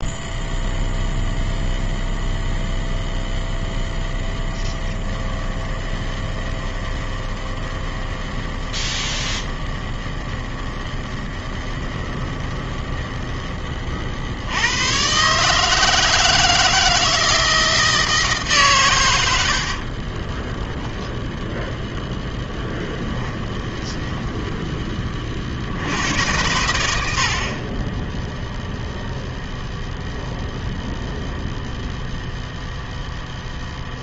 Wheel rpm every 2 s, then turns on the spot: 0, 0, 10, 20, 20, 20, 20, 90, 160, 130, 10, 10, 20, 100, 0, 0, 0.
4-14 22-24